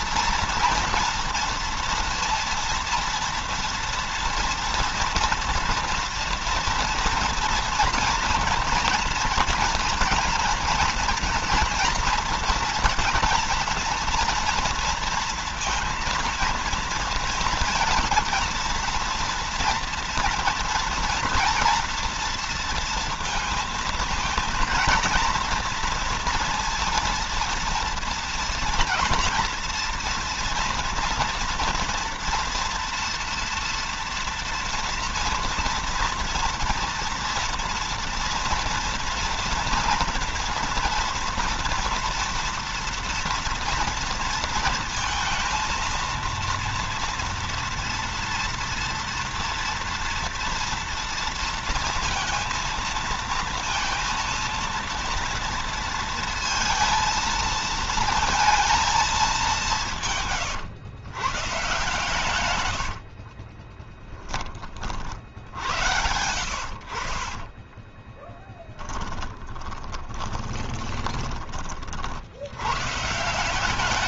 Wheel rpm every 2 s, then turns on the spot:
230, 230, 230, 230, 230, 240, 230, 230, 230, 230, 230, 230, 220, 230, 230, 230, 240, 230, 230, 230, 230, 230, 230, 230, 240, 230, 230, 230, 230, 230, 130, 90, 30, 70, 10, 20, 110.
62-64 68-72